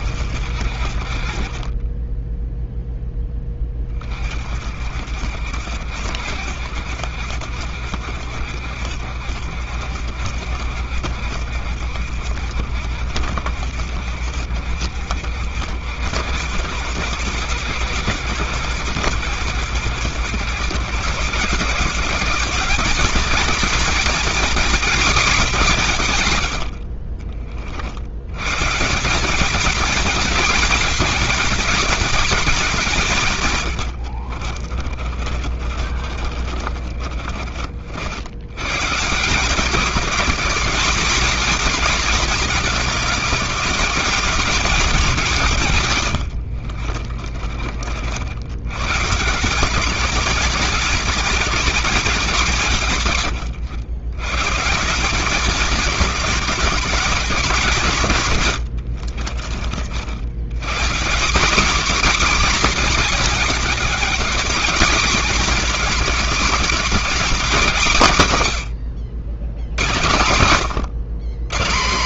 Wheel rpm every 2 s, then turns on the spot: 60, 10, 40, 70, 70, 70, 70, 60, 90, 120, 120, 190, 240, 100, 100, 230, 220, 50, 50, 100, 210, 220, 220, 90, 80, 220, 190, 140, 220, 110, 100, 240, 230, 230, 150, 110.
2-4 34-38 46-48 58-60